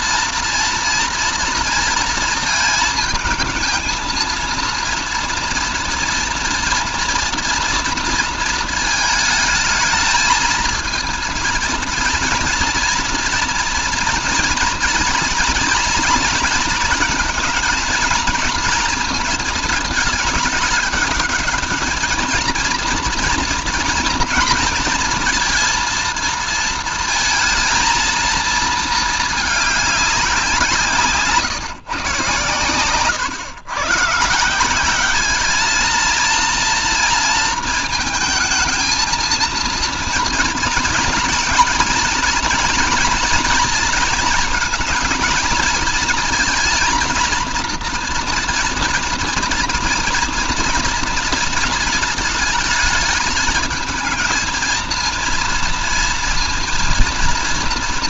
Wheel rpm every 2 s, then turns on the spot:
230, 220, 230, 230, 220, 230, 230, 230, 220, 220, 210, 230, 230, 230, 230, 170, 120, 180, 230, 220, 230, 230, 230, 230, 230, 230, 220, 230, 230.
none